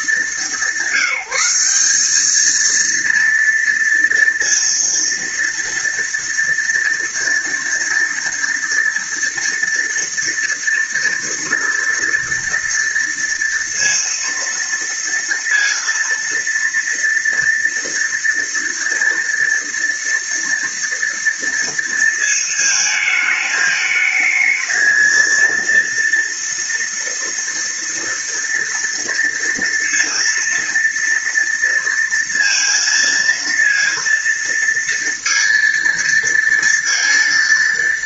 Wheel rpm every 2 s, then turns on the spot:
190, 230, 230, 230, 230, 230, 230, 230, 230, 230, 230, 220, 220, 230, 230, 230, 230, 230, 230.
none